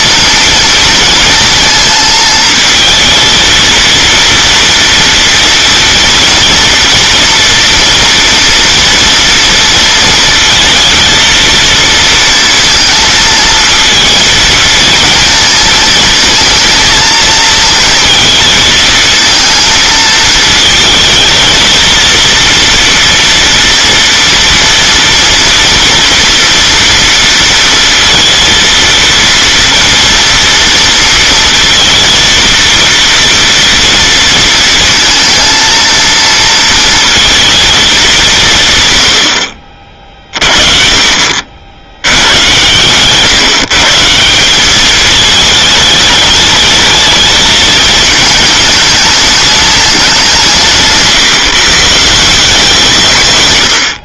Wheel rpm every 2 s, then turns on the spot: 230, 220, 230, 230, 230, 230, 230, 230, 220, 220, 220, 240, 230, 230, 230, 230, 230, 230, 230, 130, 40, 120, 200, 210, 220, 160, 170.
none